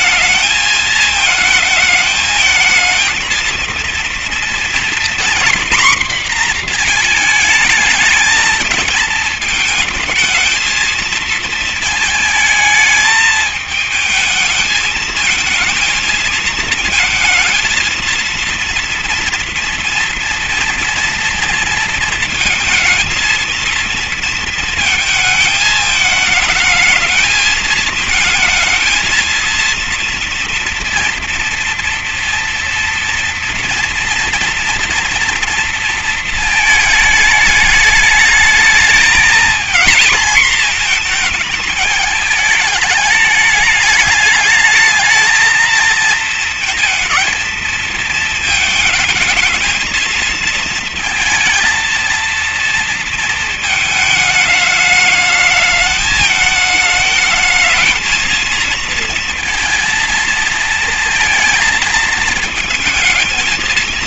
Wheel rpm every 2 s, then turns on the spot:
220, 230, 230, 230, 220, 220, 220, 220, 230, 230, 230, 230, 230, 220, 220, 230, 230, 240, 220, 220, 230, 210, 210, 230, 220, 230, 230, 210, 210, 220, 230, 220.
none